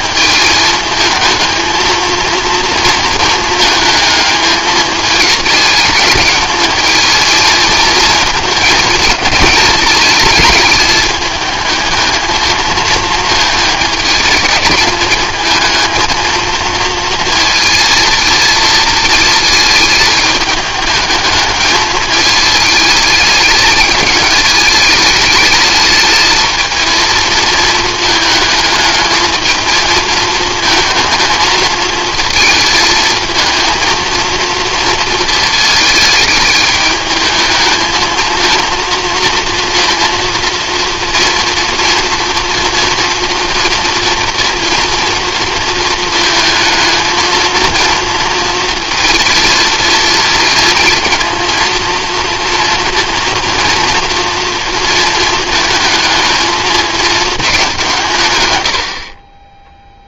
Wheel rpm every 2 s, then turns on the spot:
220, 230, 220, 220, 220, 210, 220, 210, 230, 220, 210, 220, 210, 220, 220, 220, 230, 220, 210, 230, 240, 230, 230, 220, 230, 230, 230, 220, 220, 60.
none